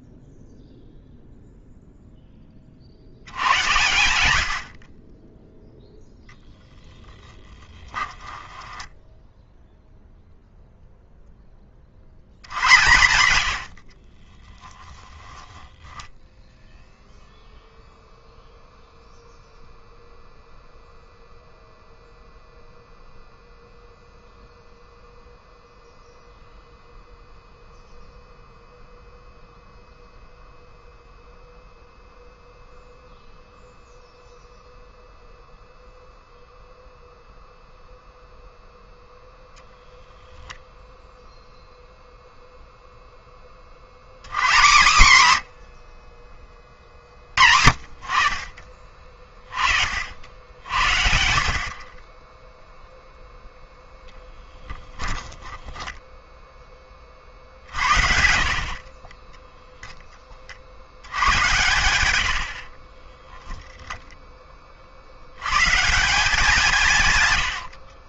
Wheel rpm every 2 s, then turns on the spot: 0, 30, 70, 10, 10, 0, 100, 10, 0, 0, 0, 0, 0, 0, 0, 0, 0, 0, 0, 0, 0, 0, 130, 40, 40, 60, 0, 10, 10, 50, 60, 40, 30, 160.
8-10 54-56 62-64